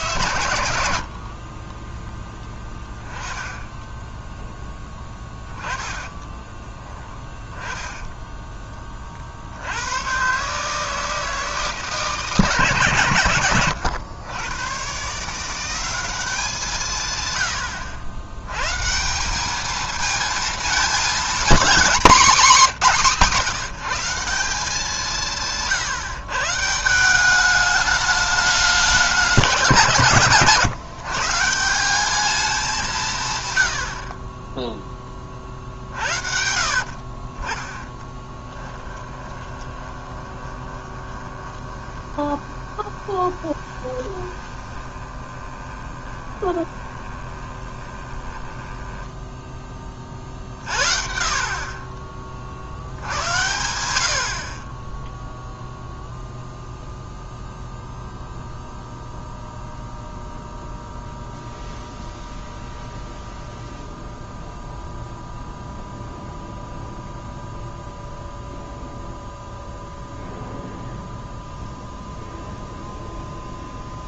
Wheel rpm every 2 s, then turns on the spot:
80, 10, 10, 20, 20, 140, 160, 110, 170, 120, 220, 220, 180, 150, 210, 150, 200, 20, 60, 10, 20, 20, 20, 20, 10, 50, 40, 50, 0, 0, 0, 0, 0, 0, 0, 0, 0.
2-4 6-8 36-50